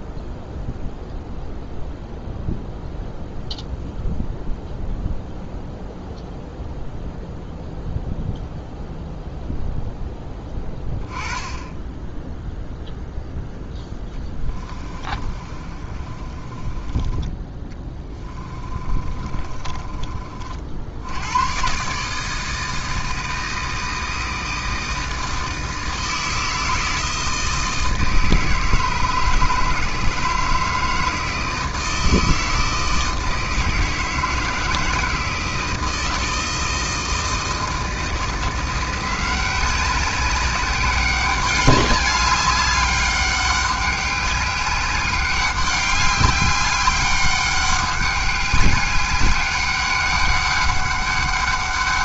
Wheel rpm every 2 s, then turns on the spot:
0, 0, 0, 0, 0, 10, 0, 20, 20, 30, 70, 160, 160, 160, 160, 150, 160, 160, 160, 170, 190, 200, 200, 200, 200, 200.
14-20